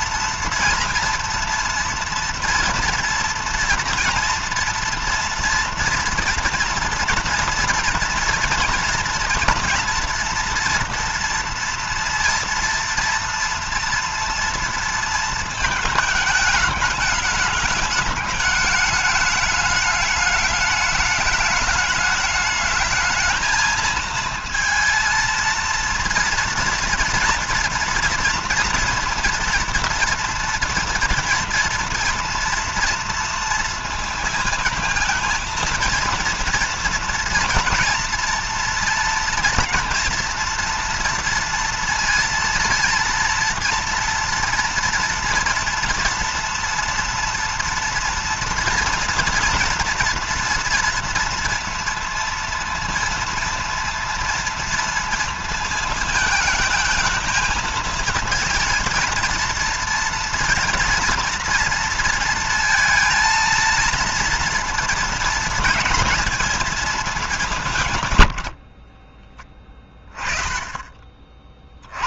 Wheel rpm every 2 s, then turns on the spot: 230, 230, 230, 230, 230, 230, 230, 230, 210, 210, 210, 220, 230, 230, 230, 230, 230, 220, 230, 230, 230, 230, 230, 230, 240, 240, 230, 230, 220, 230, 230, 230, 230, 210, 30, 40.
68-70